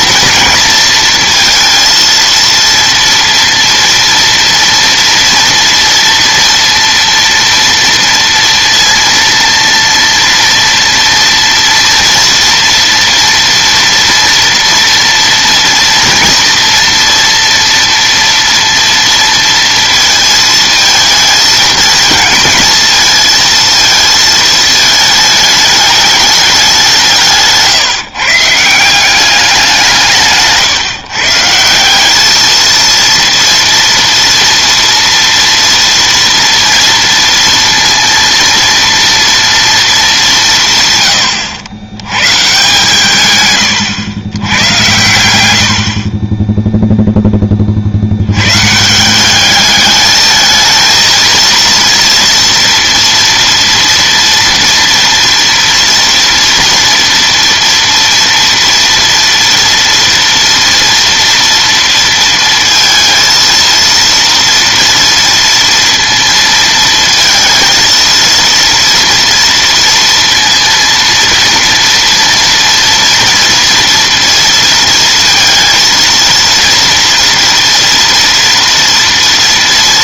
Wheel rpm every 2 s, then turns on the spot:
230, 230, 230, 230, 230, 230, 230, 230, 230, 230, 220, 220, 220, 200, 160, 150, 220, 240, 230, 230, 160, 140, 100, 10, 130, 220, 230, 230, 230, 230, 230, 230, 230, 230, 230, 230, 230, 230, 230, 230.
none